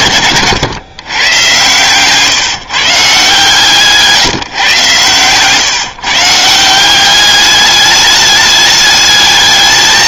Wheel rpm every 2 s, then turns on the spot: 110, 150, 130, 170, 210.
none